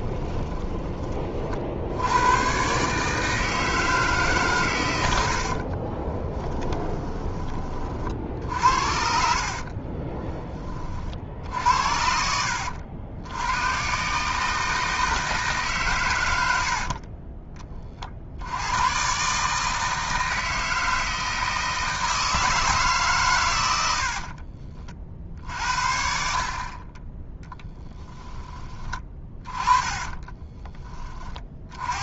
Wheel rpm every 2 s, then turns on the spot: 20, 130, 120, 20, 60, 30, 80, 160, 70, 100, 160, 150, 40, 30, 20, 30.
6-8 16-18